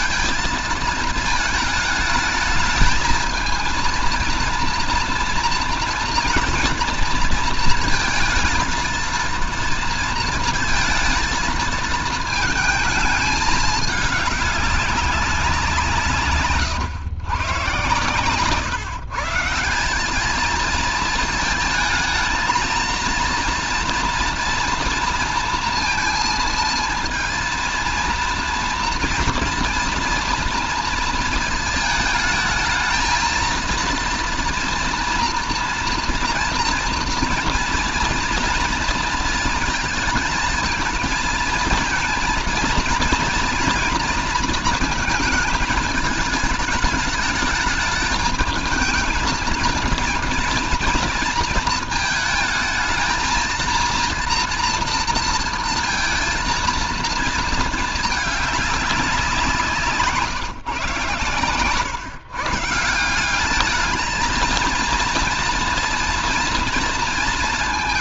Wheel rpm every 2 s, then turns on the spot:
220, 220, 230, 230, 230, 230, 220, 200, 140, 150, 220, 230, 230, 230, 230, 230, 220, 230, 230, 230, 220, 230, 230, 220, 220, 230, 220, 230, 230, 210, 140, 160, 230, 230.
none